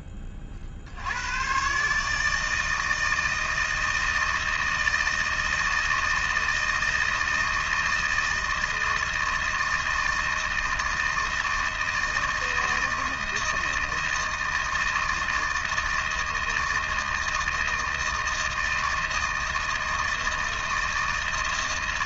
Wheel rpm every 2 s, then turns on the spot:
90, 160, 160, 160, 160, 160, 160, 160, 160, 160, 160.
none